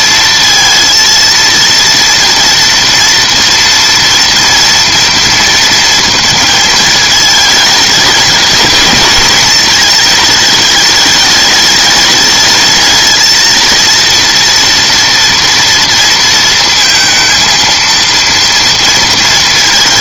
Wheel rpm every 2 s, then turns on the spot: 230, 230, 230, 230, 220, 210, 210, 240, 230, 230.
none